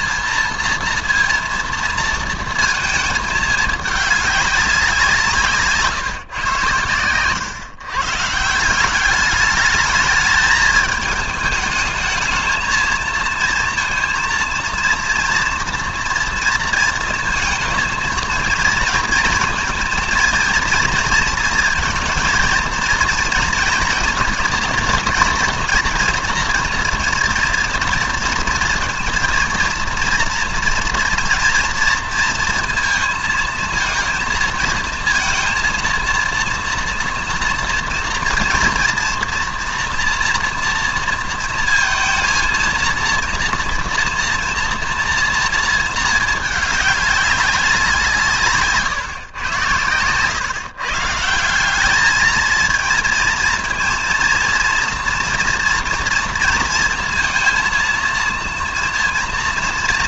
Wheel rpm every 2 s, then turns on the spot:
230, 220, 190, 120, 170, 210, 220, 230, 230, 230, 230, 230, 230, 230, 230, 230, 230, 230, 230, 230, 230, 230, 230, 210, 150, 140, 220, 230, 230, 230.
none